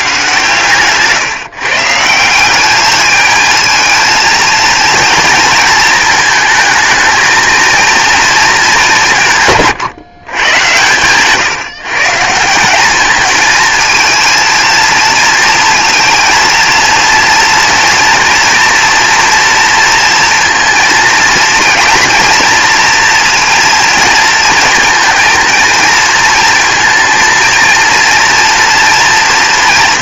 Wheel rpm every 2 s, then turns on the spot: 130, 210, 230, 220, 190, 120, 200, 230, 230, 230, 230, 240, 230, 230, 230.
none